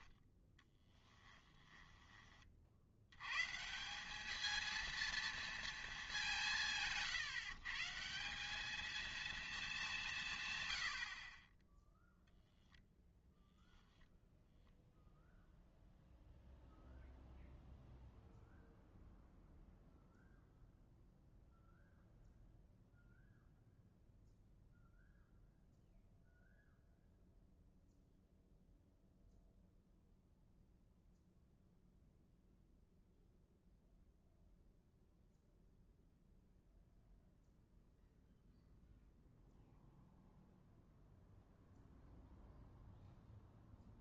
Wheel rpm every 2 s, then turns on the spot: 10, 50, 230, 160, 200, 120, 0, 0, 0, 0, 0, 0, 0, 0, 0, 0, 0, 0, 0, 0, 0, 0.
none